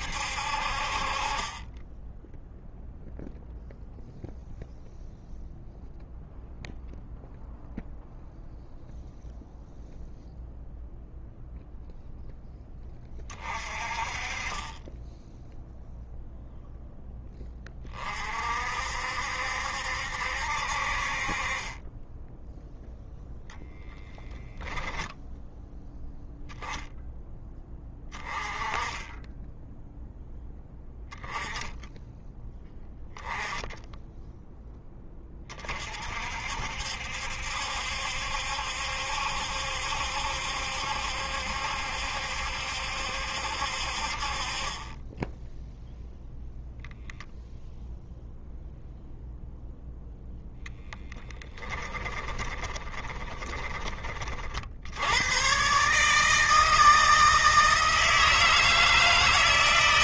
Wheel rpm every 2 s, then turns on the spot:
50, 0, 0, 0, 0, 0, 10, 10, 10, 60, 60, 0, 0, 10, 20, 10, 10, 10, 60, 70, 70, 70, 20, 0, 0, 0, 20, 80, 160, 160.
52-54